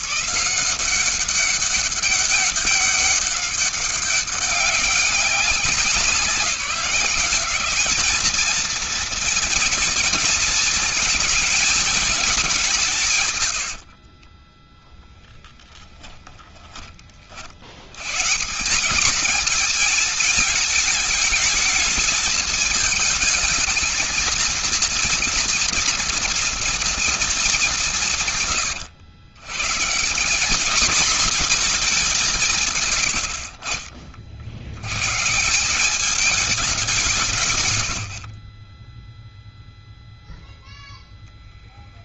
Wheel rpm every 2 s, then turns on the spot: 170, 200, 190, 170, 230, 230, 180, 10, 30, 190, 220, 220, 230, 240, 110, 220, 150, 90, 200, 30, 0.
14-16 38-40